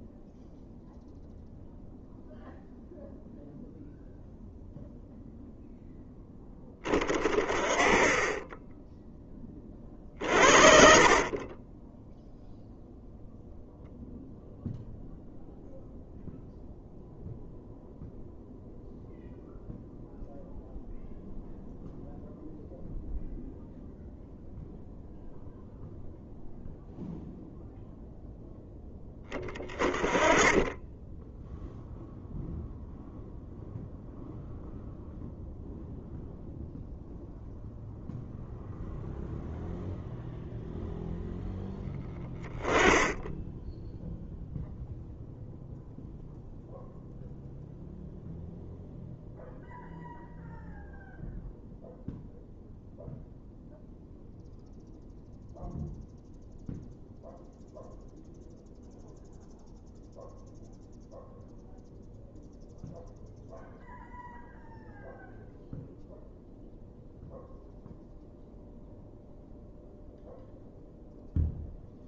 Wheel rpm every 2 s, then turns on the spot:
0, 0, 0, 20, 10, 60, 0, 0, 0, 0, 0, 0, 0, 0, 10, 10, 0, 0, 0, 0, 0, 10, 0, 0, 0, 0, 0, 0, 0, 0, 0, 0, 0, 0, 0, 0.
10-12